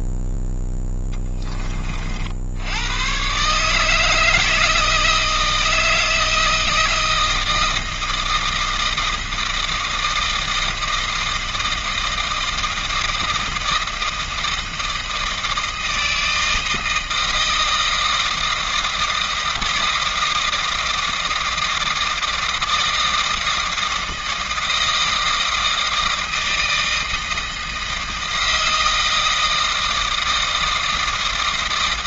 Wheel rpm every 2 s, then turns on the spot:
0, 70, 160, 160, 160, 160, 160, 160, 160, 160, 160, 160, 160, 160, 160, 160.
none